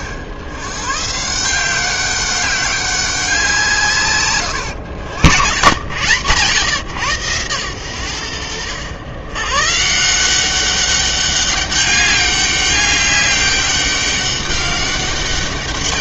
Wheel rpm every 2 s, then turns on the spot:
110, 190, 110, 130, 90, 190, 200, 200.
none